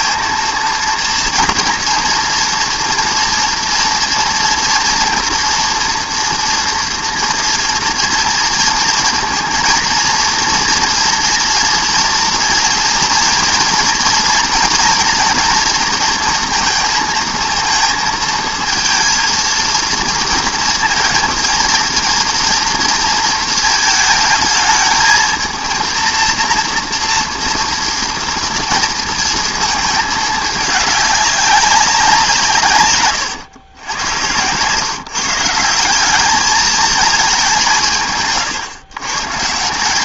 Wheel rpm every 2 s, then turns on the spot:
230, 240, 240, 230, 230, 230, 230, 230, 230, 230, 230, 230, 220, 230, 230, 210, 150, 120, 210, 130.
none